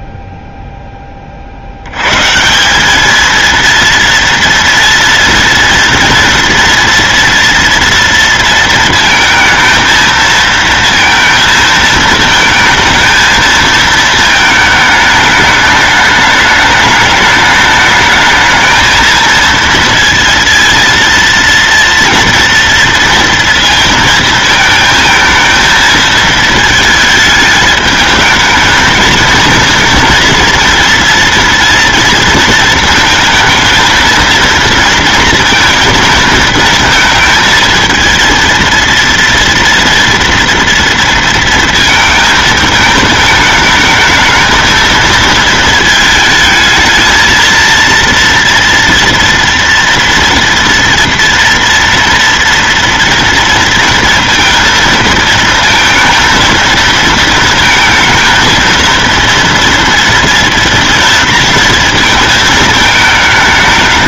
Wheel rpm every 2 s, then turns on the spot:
0, 170, 230, 230, 230, 220, 220, 220, 210, 220, 230, 230, 220, 220, 220, 230, 220, 230, 230, 230, 230, 220, 220, 220, 230, 230, 230, 230, 230, 230, 230, 220.
none